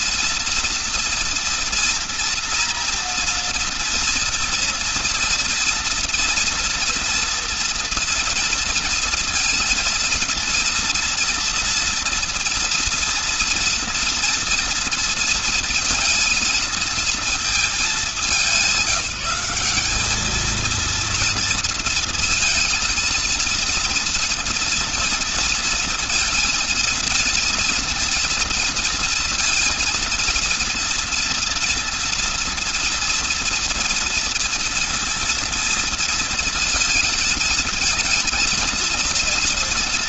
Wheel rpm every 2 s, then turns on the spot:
230, 230, 240, 230, 230, 230, 230, 230, 210, 190, 230, 230, 230, 230, 230, 230, 230, 230, 230, 230.
none